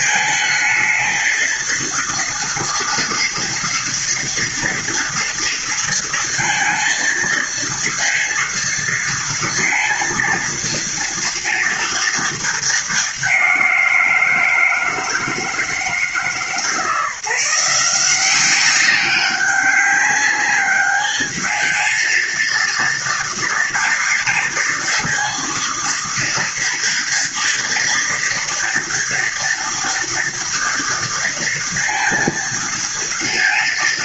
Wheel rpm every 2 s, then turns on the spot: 230, 240, 230, 230, 230, 230, 200, 160, 160, 200, 210, 230, 230, 230, 230, 230, 230.
none